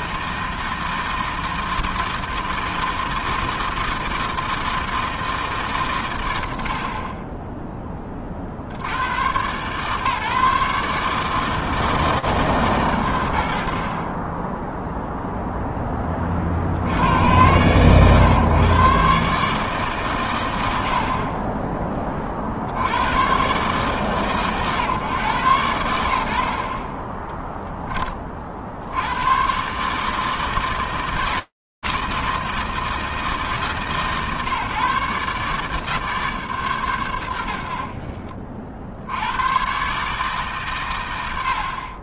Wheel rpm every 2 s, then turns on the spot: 160, 160, 160, 100, 40, 150, 130, 10, 30, 120, 100, 50, 140, 80, 40, 160, 160, 140, 140, 40, 150.
none